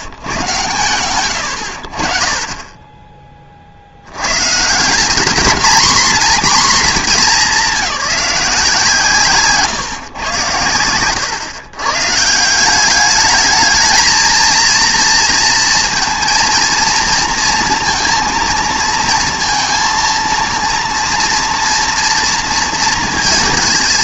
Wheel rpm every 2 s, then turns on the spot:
80, 20, 170, 230, 160, 100, 190, 230, 230, 230, 230, 230.
none